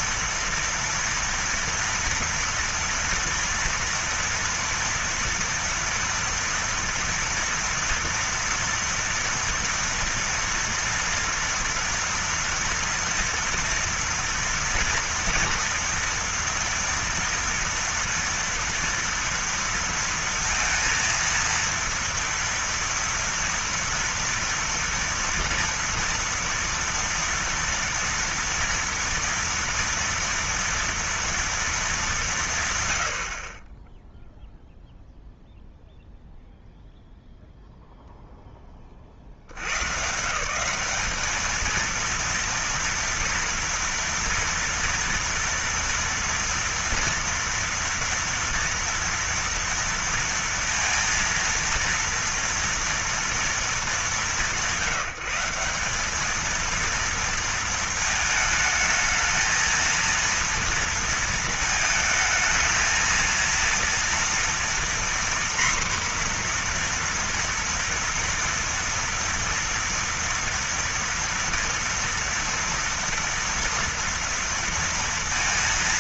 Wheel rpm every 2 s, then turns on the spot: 230, 240, 230, 230, 230, 230, 230, 230, 230, 230, 230, 230, 230, 230, 230, 230, 150, 0, 0, 20, 180, 240, 230, 240, 230, 230, 230, 180, 220, 220, 230, 220, 240, 240, 230, 240, 230, 230.
none